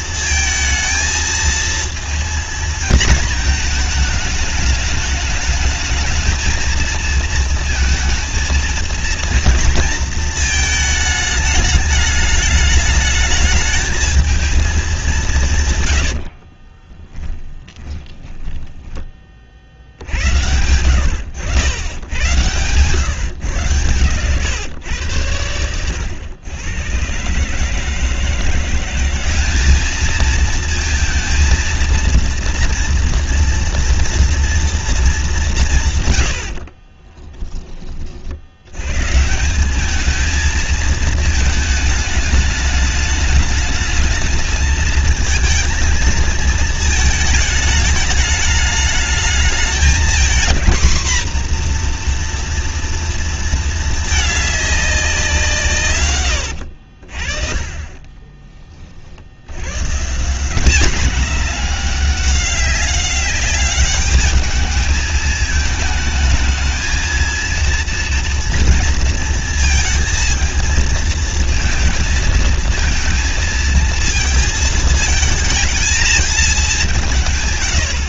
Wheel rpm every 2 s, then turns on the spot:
220, 230, 210, 230, 230, 220, 210, 210, 40, 10, 90, 120, 120, 110, 180, 230, 230, 230, 50, 100, 220, 210, 220, 230, 210, 240, 240, 200, 70, 30, 200, 200, 210, 220, 230, 230, 230, 220, 200.
16-20 36-38 56-58